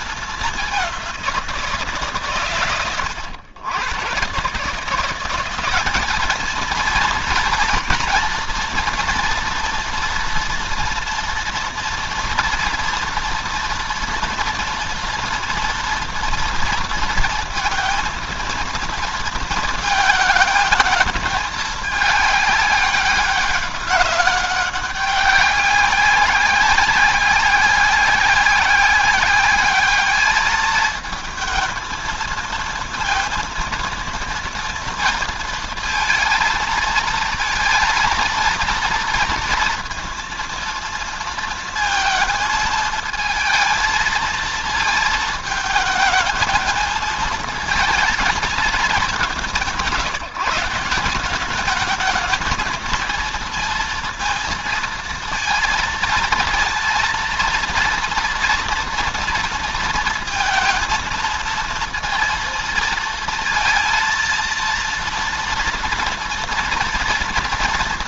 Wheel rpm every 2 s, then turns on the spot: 190, 110, 180, 230, 230, 230, 240, 230, 230, 230, 220, 200, 200, 190, 190, 220, 230, 230, 230, 230, 230, 220, 230, 220, 200, 170, 230, 230, 230, 230, 230, 230, 230, 230.
none